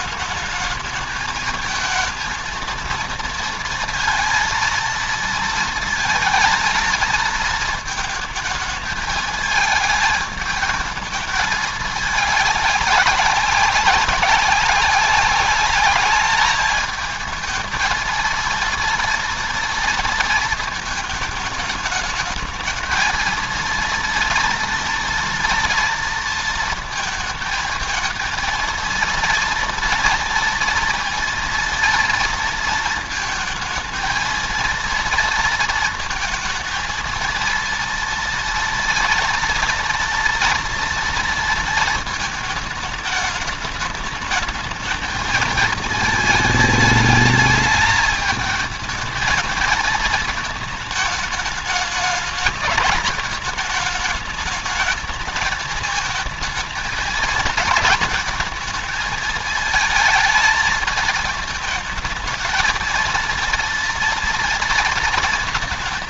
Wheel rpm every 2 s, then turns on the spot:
210, 230, 230, 230, 220, 220, 210, 190, 220, 230, 220, 220, 230, 230, 230, 230, 230, 230, 230, 230, 230, 220, 210, 220, 220, 220, 210, 210, 220, 220, 220, 220, 230.
none